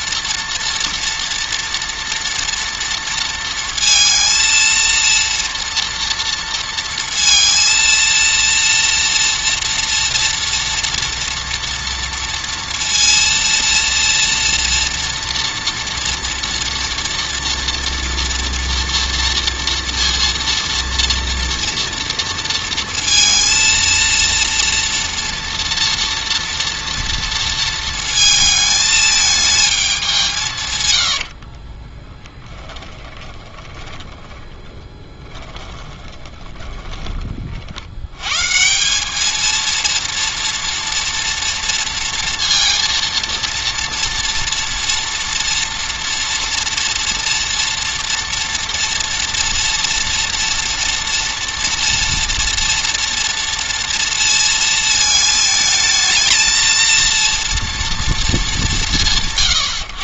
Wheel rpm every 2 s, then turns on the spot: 230, 230, 230, 230, 230, 230, 230, 230, 230, 230, 230, 230, 230, 230, 220, 120, 10, 20, 20, 180, 230, 230, 240, 230, 230, 230, 230, 220, 230, 190.
30-38